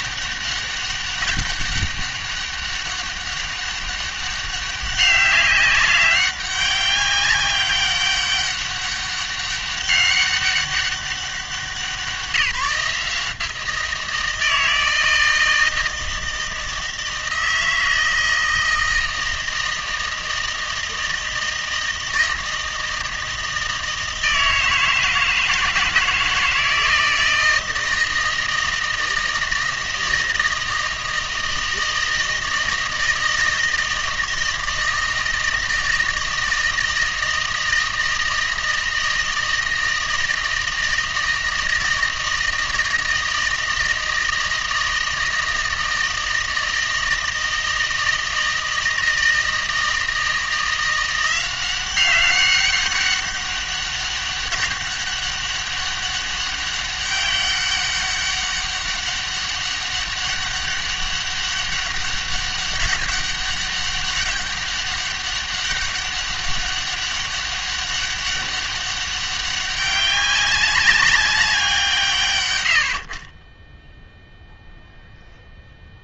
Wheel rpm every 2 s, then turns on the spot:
200, 200, 200, 200, 200, 200, 160, 160, 160, 160, 160, 160, 160, 160, 160, 160, 160, 160, 160, 160, 160, 160, 160, 160, 160, 170, 200, 200, 200, 200, 200, 200, 200, 200, 200, 200, 80, 0.
none